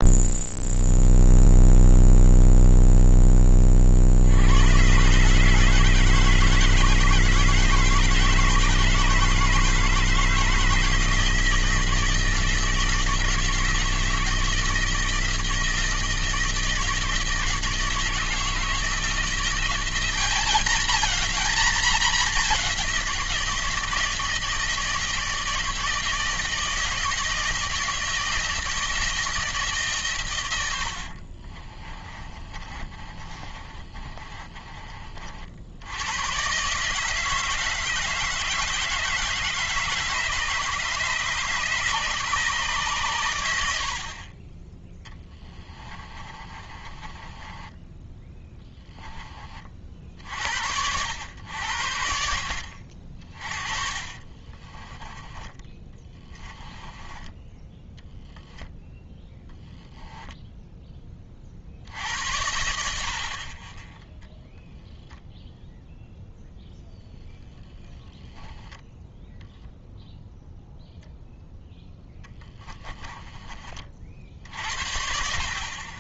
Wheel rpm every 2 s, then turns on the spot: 0, 0, 120, 160, 160, 160, 160, 160, 160, 160, 210, 190, 160, 160, 160, 80, 30, 40, 140, 160, 150, 130, 10, 30, 10, 80, 50, 20, 20, 0, 10, 70, 0, 10, 10, 0, 10, 60.
32-34 46-48 54-58 72-74